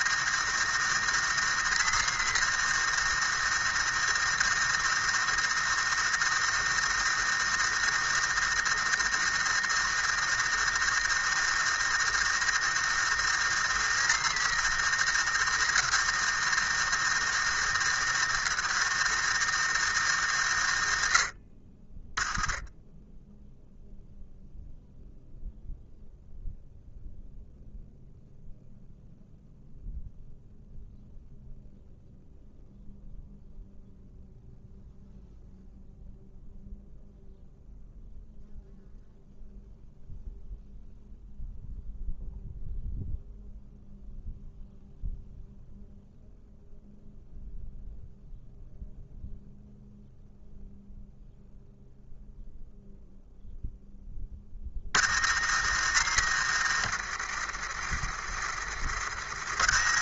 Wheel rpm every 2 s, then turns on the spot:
110, 110, 110, 110, 110, 110, 110, 110, 110, 110, 80, 10, 0, 0, 0, 0, 0, 0, 0, 0, 0, 0, 0, 0, 0, 0, 0, 40, 80, 50.
none